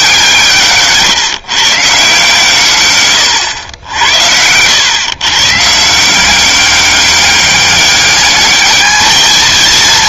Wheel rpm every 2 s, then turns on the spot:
160, 150, 90, 190, 210.
none